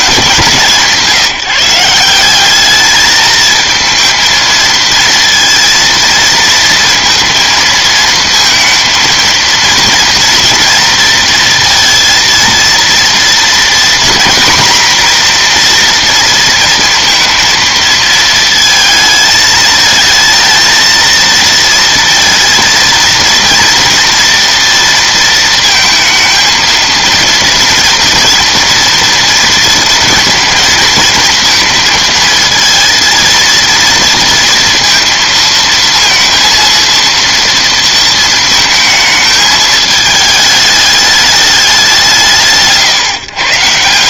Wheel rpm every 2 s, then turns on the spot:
200, 180, 220, 230, 230, 230, 230, 230, 240, 230, 220, 230, 230, 230, 240, 230, 220, 230, 230, 220, 210, 160.
none